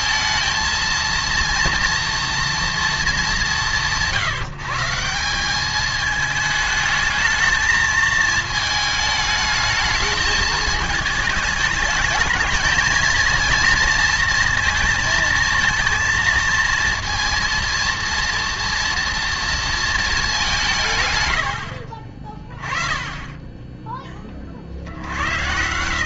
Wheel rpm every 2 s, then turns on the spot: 220, 240, 150, 220, 220, 220, 230, 230, 230, 230, 180, 30, 60.
none